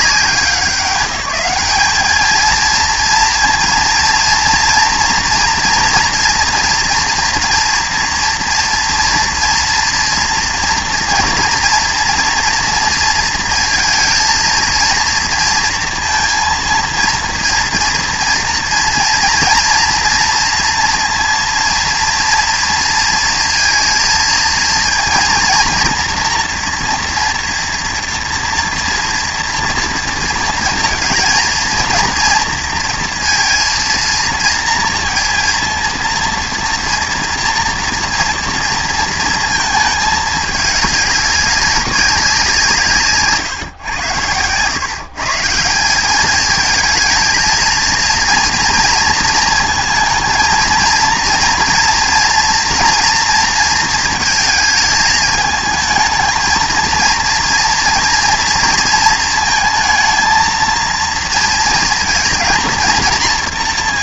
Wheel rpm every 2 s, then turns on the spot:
190, 230, 230, 230, 240, 230, 230, 230, 230, 230, 230, 230, 230, 230, 230, 230, 230, 230, 230, 230, 200, 160, 120, 220, 230, 230, 230, 220, 230, 230, 230, 220.
none